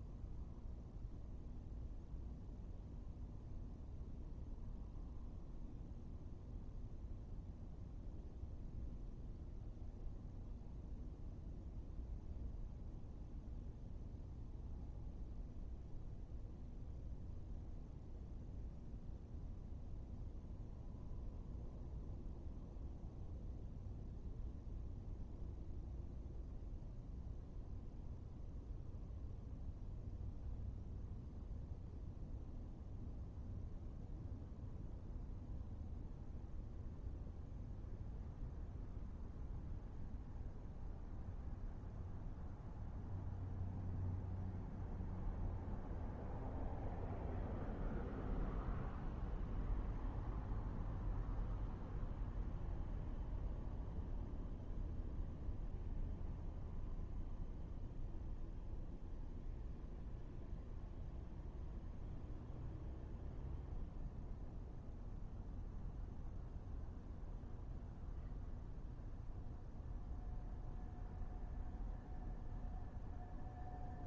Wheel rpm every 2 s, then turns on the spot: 0, 0, 0, 0, 0, 0, 0, 0, 0, 0, 0, 0, 0, 0, 0, 0, 0, 0, 0, 0, 0, 0, 0, 0, 0, 0, 0, 0, 0, 0, 0, 0, 0, 0, 0, 0, 0.
none